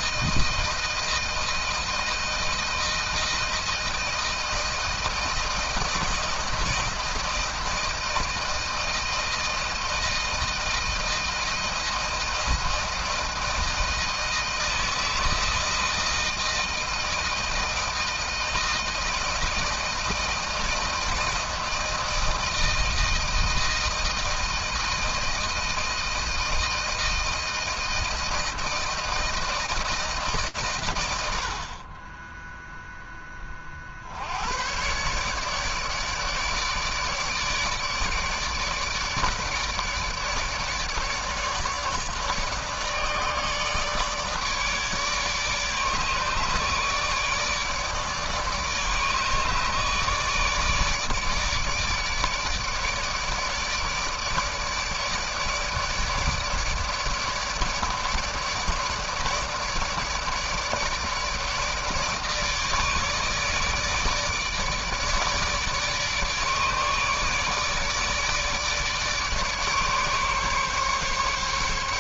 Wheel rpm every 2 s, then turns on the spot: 160, 160, 160, 160, 160, 160, 160, 160, 160, 160, 160, 160, 160, 160, 160, 120, 0, 100, 150, 150, 150, 150, 150, 150, 150, 160, 160, 150, 150, 150, 150, 160, 150, 150, 150, 150.
none